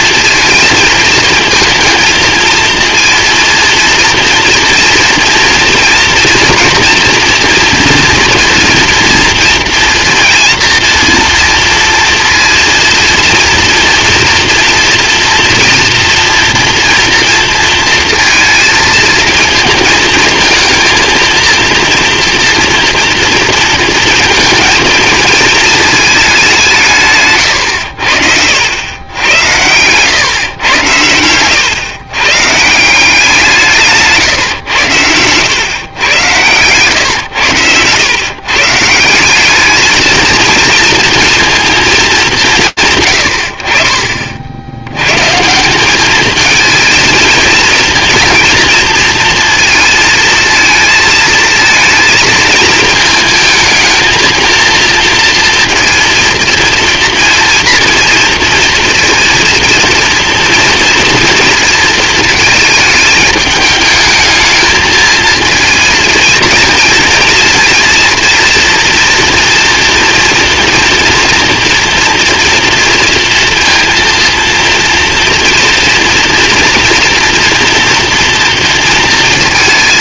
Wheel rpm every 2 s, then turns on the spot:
220, 220, 230, 230, 230, 230, 230, 230, 240, 230, 230, 230, 230, 180, 80, 110, 150, 120, 110, 150, 220, 140, 80, 220, 230, 220, 220, 230, 230, 230, 230, 220, 220, 230, 230, 230, 230, 230, 230, 230.
36-38